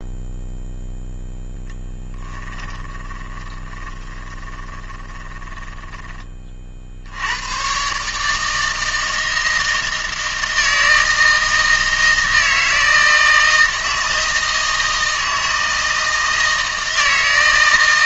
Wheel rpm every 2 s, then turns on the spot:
0, 10, 20, 40, 160, 160, 160, 160, 160.
2-6